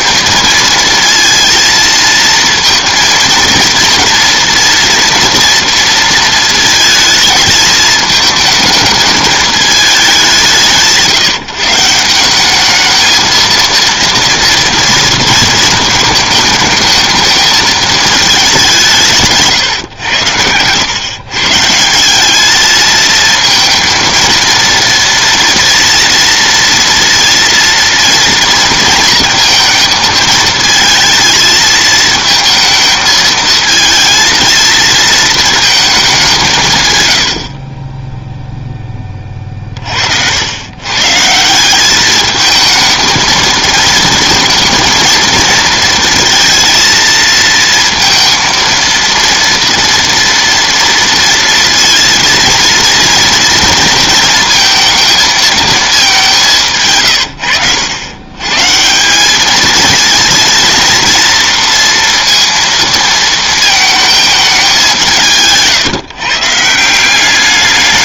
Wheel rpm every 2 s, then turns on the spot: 220, 230, 230, 220, 220, 170, 210, 230, 220, 180, 110, 220, 230, 230, 230, 220, 220, 220, 140, 10, 110, 220, 230, 230, 230, 230, 230, 220, 150, 150, 230, 230, 200, 160.
none